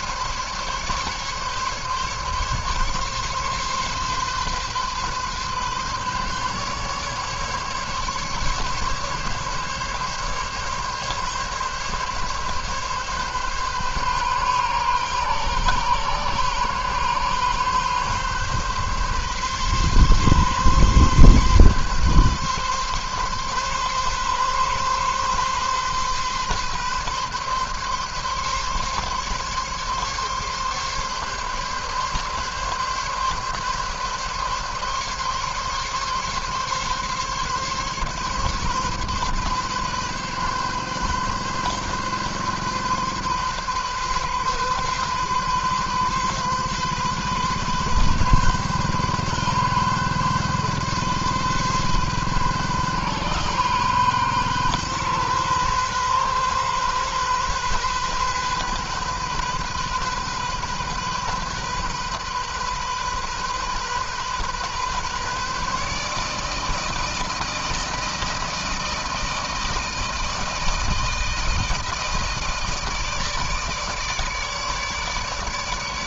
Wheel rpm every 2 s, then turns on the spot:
140, 140, 140, 140, 140, 140, 140, 140, 140, 130, 140, 130, 130, 140, 140, 140, 140, 140, 140, 140, 130, 130, 130, 130, 130, 130, 130, 130, 130, 130, 130, 130, 130, 160, 160, 160, 160, 150.
none